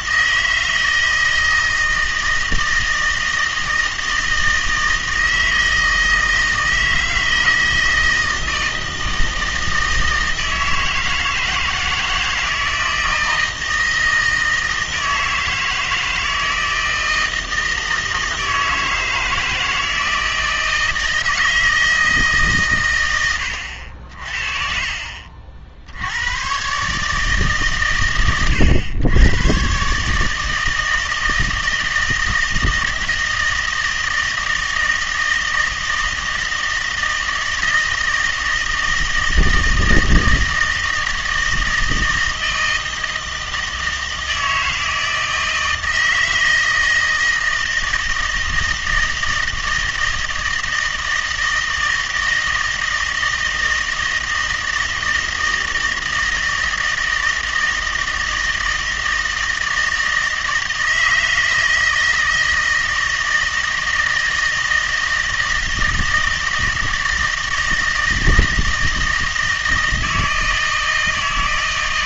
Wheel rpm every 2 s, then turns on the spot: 160, 160, 160, 160, 160, 160, 160, 160, 160, 160, 160, 130, 50, 130, 110, 160, 160, 160, 160, 160, 160, 160, 160, 160, 160, 160, 160, 160, 160, 160, 160, 160, 160, 160, 160, 160.
none